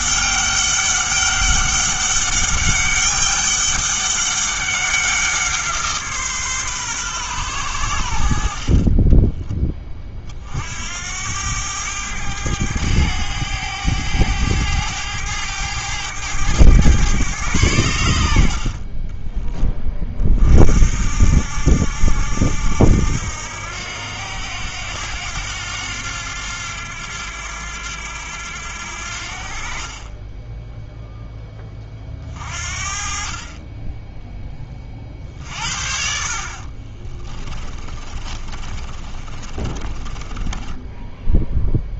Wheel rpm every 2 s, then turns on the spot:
200, 200, 200, 140, 40, 60, 100, 100, 110, 50, 50, 80, 90, 90, 80, 0, 50, 20, 40, 30, 20.
36-42